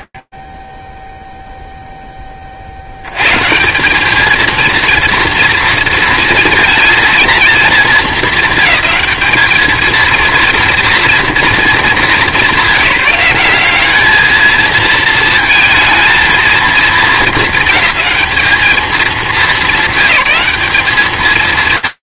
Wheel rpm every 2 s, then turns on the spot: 0, 40, 230, 230, 200, 230, 180, 220, 230, 210, 200.
none